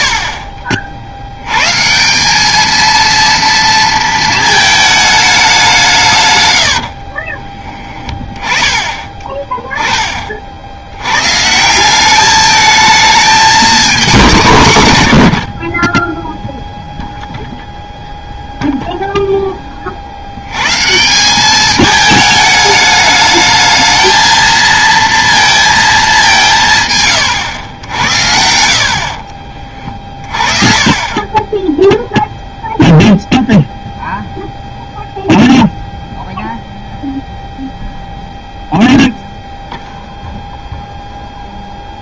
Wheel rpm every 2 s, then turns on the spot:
50, 210, 220, 100, 20, 60, 210, 190, 0, 0, 160, 210, 230, 140, 50, 20, 0, 0, 0, 0, 0.
6-8